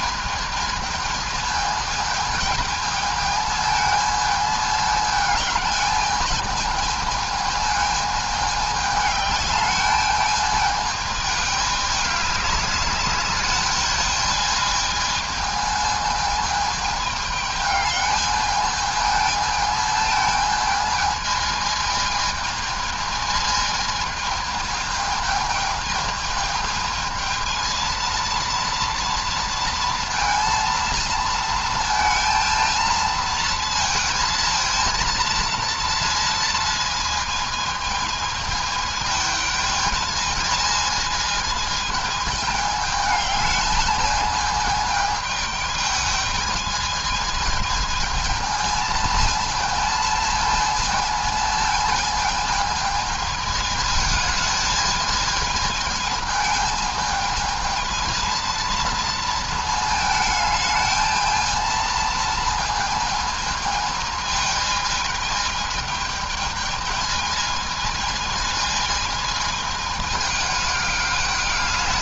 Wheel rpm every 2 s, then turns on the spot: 220, 220, 210, 220, 210, 220, 200, 220, 220, 220, 220, 220, 220, 220, 230, 230, 230, 230, 230, 220, 220, 220, 220, 210, 220, 220, 220, 220, 220, 230, 220, 220, 220, 220, 220, 210.
none